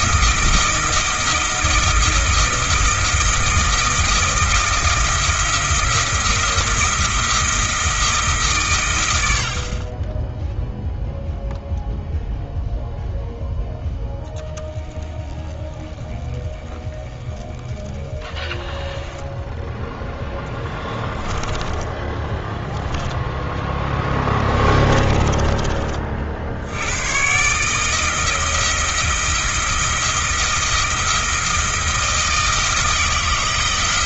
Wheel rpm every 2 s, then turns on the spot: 160, 170, 170, 170, 120, 0, 0, 10, 20, 10, 10, 10, 20, 90, 170, 170, 160.
22-26